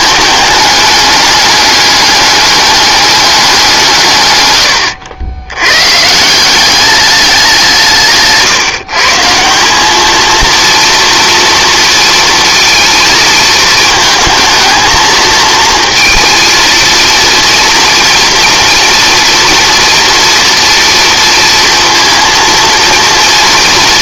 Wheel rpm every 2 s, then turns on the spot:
210, 210, 100, 190, 160, 230, 230, 220, 220, 230, 230, 230.
none